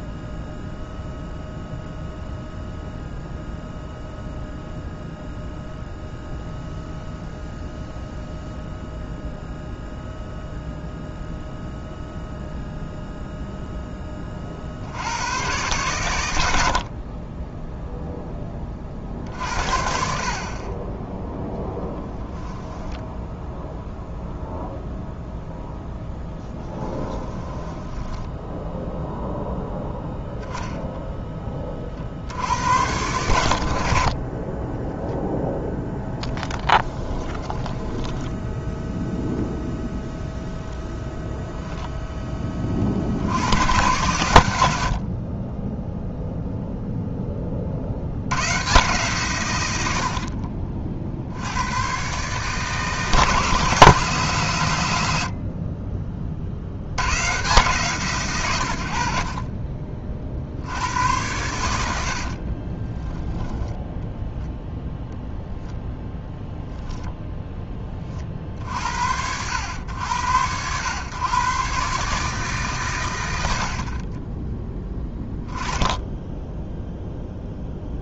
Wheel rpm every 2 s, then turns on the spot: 0, 0, 0, 0, 0, 0, 0, 60, 50, 30, 20, 10, 0, 20, 0, 10, 90, 10, 10, 0, 0, 40, 80, 0, 130, 50, 150, 110, 80, 90, 80, 20, 0, 0, 60, 110, 120, 10, 0.
22-24 26-28 36-38 62-64